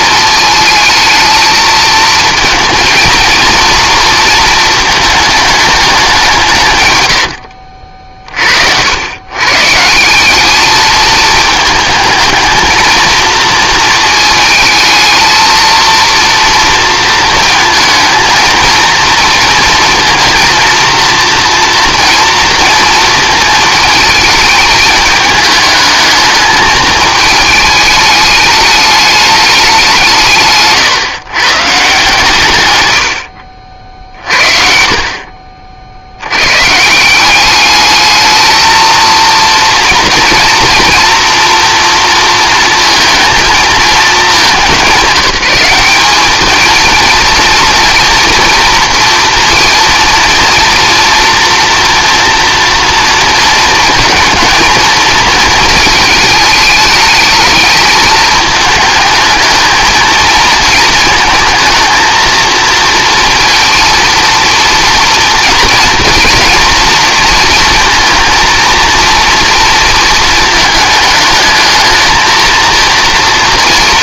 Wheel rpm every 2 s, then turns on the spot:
220, 230, 230, 130, 70, 210, 220, 220, 230, 230, 230, 230, 220, 210, 210, 140, 120, 50, 130, 220, 230, 230, 200, 220, 230, 230, 230, 220, 220, 220, 220, 230, 230, 230, 230, 220, 230.
none